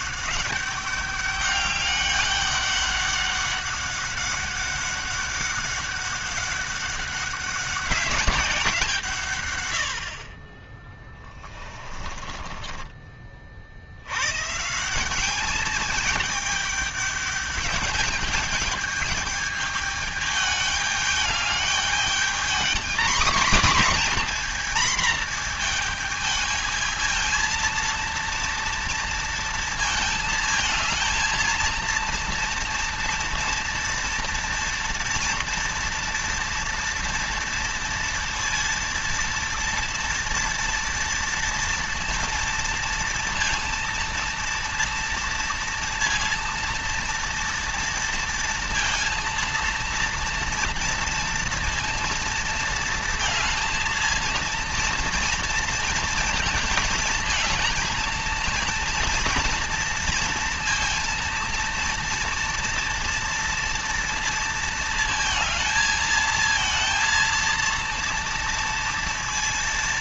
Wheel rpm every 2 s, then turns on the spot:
200, 200, 200, 190, 140, 20, 30, 180, 210, 210, 210, 240, 230, 220, 230, 220, 230, 230, 230, 230, 230, 230, 230, 230, 230, 230, 230, 230, 230, 230, 230, 230, 230, 230, 230.
10-12